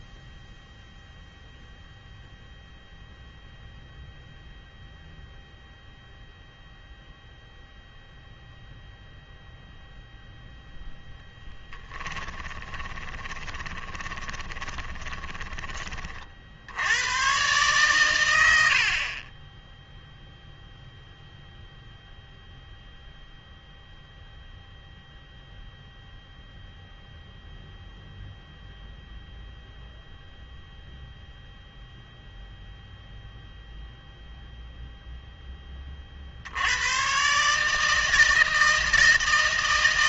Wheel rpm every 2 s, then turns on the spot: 0, 0, 0, 0, 0, 0, 20, 20, 80, 60, 0, 0, 0, 0, 0, 0, 0, 0, 110, 160.
12-16